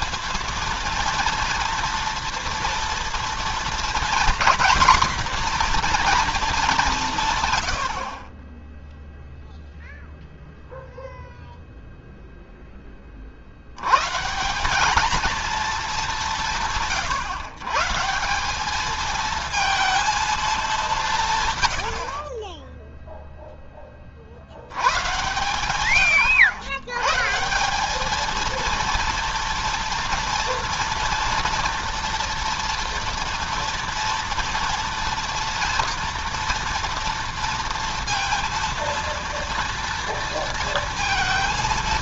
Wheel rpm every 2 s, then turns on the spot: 230, 230, 240, 150, 0, 0, 40, 220, 130, 220, 160, 0, 120, 140, 230, 230, 230, 230, 230, 230, 230.
none